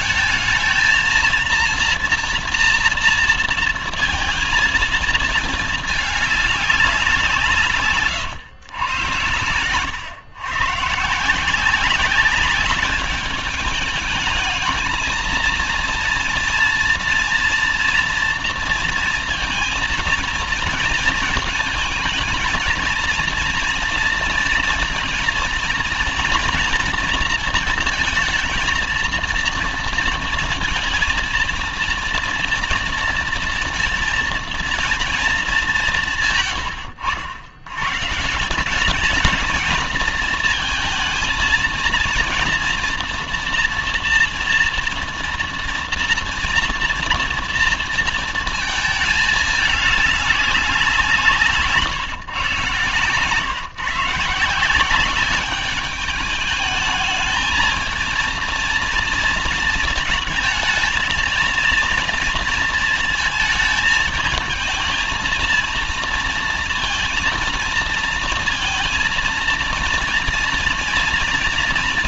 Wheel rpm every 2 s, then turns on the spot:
220, 230, 230, 200, 120, 140, 210, 220, 240, 230, 230, 220, 230, 230, 220, 230, 230, 230, 140, 170, 220, 230, 230, 230, 230, 190, 120, 170, 210, 230, 220, 230, 220, 230, 230, 230.
none